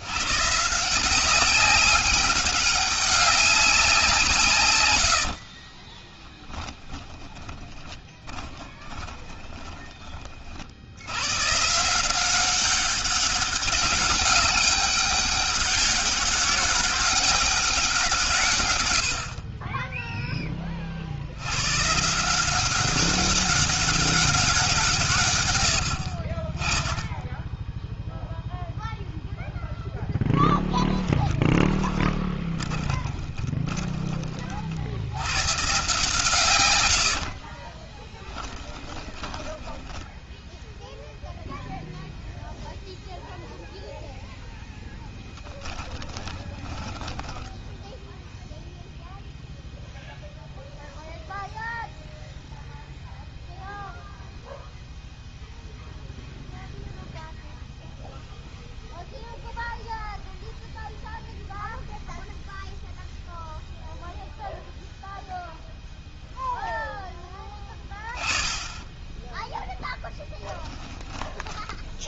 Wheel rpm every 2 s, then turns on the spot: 170, 200, 100, 10, 20, 90, 200, 200, 200, 90, 60, 190, 150, 10, 0, 10, 20, 90, 60, 10, 0, 0, 10, 10, 0, 0, 0, 0, 0, 0, 0, 0, 0, 10, 10, 20.
4-10 30-34 36-40 46-48